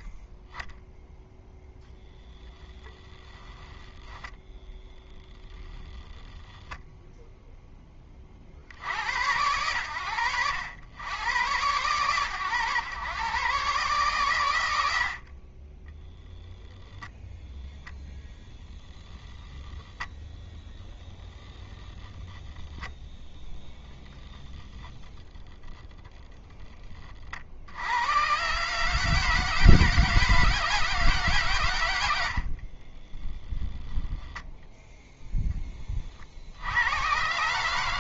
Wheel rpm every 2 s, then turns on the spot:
20, 10, 20, 10, 20, 70, 120, 120, 0, 0, 10, 0, 10, 10, 140, 160, 40, 0, 70.
2-6 32-34